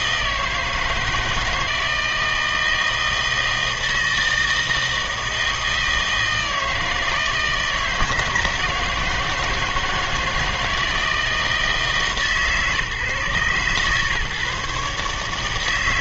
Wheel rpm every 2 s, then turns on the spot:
160, 160, 160, 160, 160, 160, 140, 140.
none